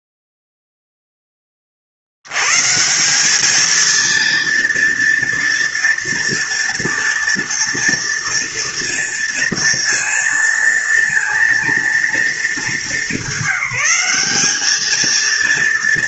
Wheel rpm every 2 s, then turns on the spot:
0, 110, 230, 230, 230, 230, 220, 200.
none